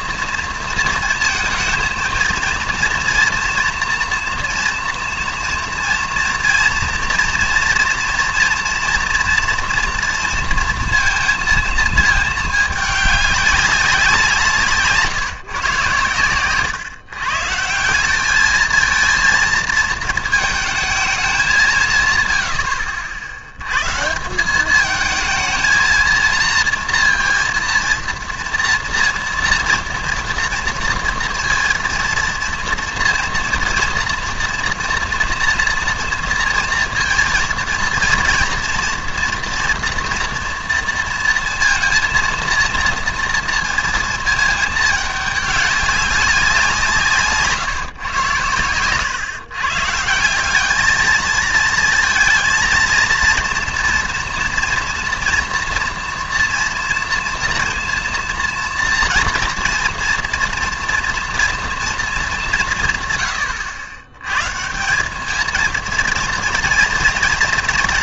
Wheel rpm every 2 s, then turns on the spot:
230, 230, 230, 230, 240, 230, 220, 160, 120, 220, 220, 90, 200, 230, 230, 230, 230, 230, 230, 230, 230, 230, 220, 180, 100, 200, 230, 230, 240, 230, 240, 180, 150, 230.
none